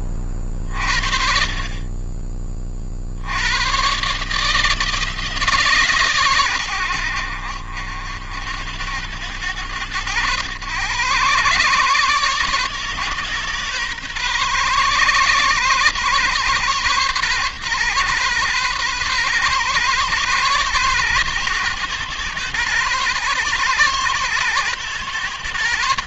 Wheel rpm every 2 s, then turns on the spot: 30, 40, 150, 120, 70, 110, 130, 130, 130, 120, 130, 120, 120.
none